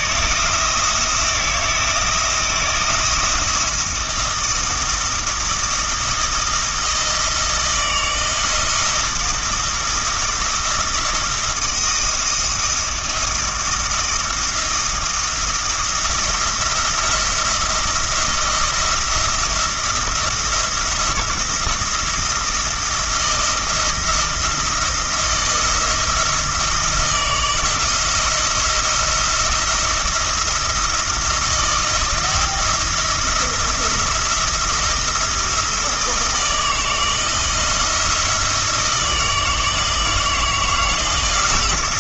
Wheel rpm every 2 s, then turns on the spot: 170, 170, 170, 160, 170, 170, 170, 170, 170, 170, 170, 170, 170, 170, 170, 170, 160, 170, 160, 160, 170.
none